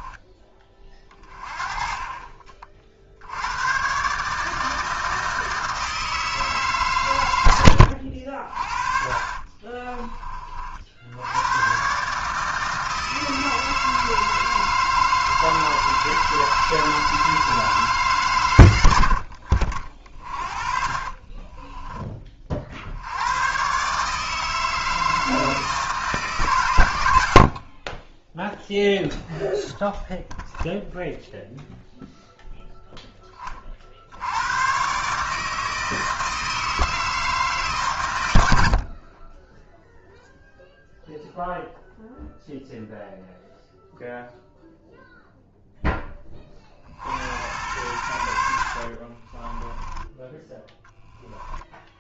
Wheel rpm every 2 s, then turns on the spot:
20, 40, 160, 150, 40, 50, 160, 160, 160, 100, 40, 70, 160, 120, 0, 0, 0, 120, 160, 60, 0, 0, 0, 40, 60, 10.
8-10 20-22 48-52